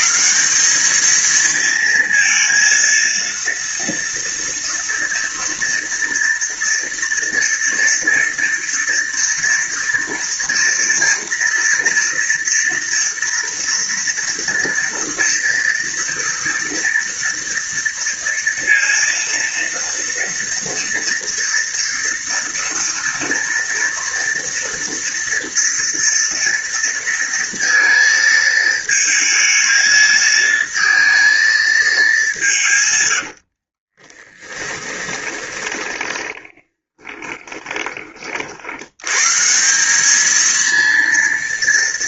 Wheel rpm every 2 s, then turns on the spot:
180, 230, 230, 230, 230, 230, 230, 230, 230, 230, 230, 230, 230, 230, 220, 220, 160, 20, 10, 60, 220.
34-38